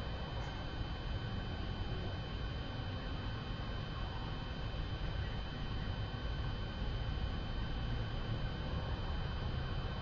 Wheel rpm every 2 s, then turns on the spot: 0, 0, 0, 0, 0.
none